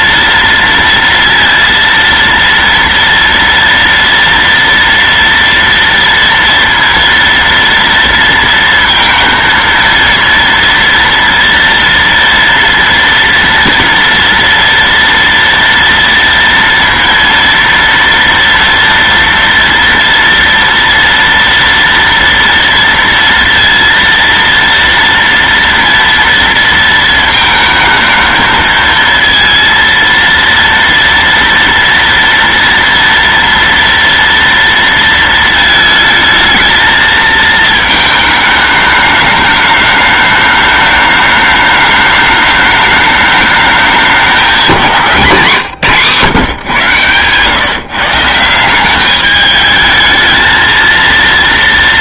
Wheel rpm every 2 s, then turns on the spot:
230, 230, 230, 230, 230, 230, 230, 230, 230, 230, 230, 230, 230, 230, 220, 230, 230, 230, 220, 220, 210, 210, 200, 140, 160, 220.
none